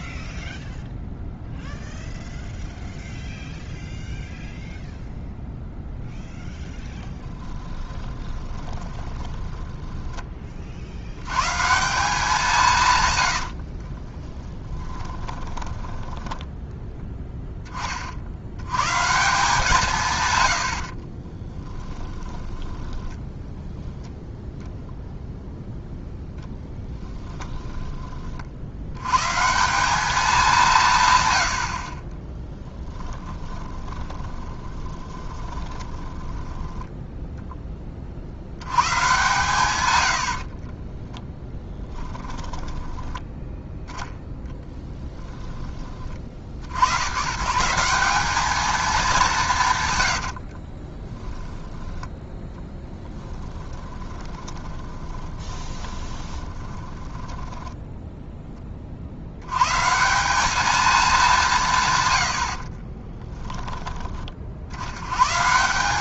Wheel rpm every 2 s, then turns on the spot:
0, 0, 0, 20, 20, 100, 110, 10, 0, 130, 40, 10, 0, 10, 110, 120, 10, 20, 10, 120, 10, 10, 10, 110, 190, 20, 20, 20, 20, 60, 200, 20, 90.
6-10 14-16 20-24 26-28 32-36 40-44 50-58 62-64